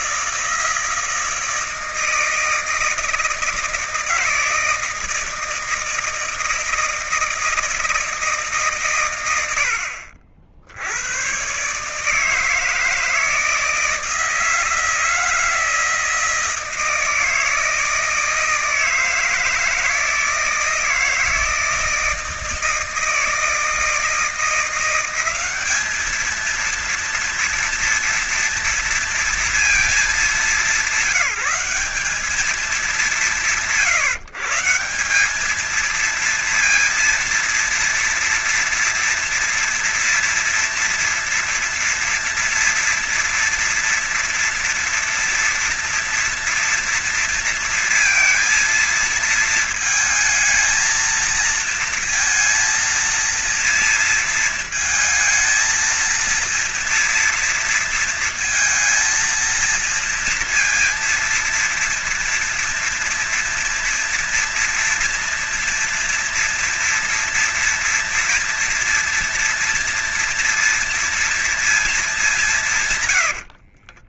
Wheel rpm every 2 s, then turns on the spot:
160, 160, 160, 160, 120, 80, 160, 160, 160, 160, 160, 160, 180, 230, 230, 200, 180, 170, 230, 230, 240, 240, 230, 230, 230, 220, 230, 220, 230, 230, 230, 230, 230, 230, 230, 230, 150.
72-74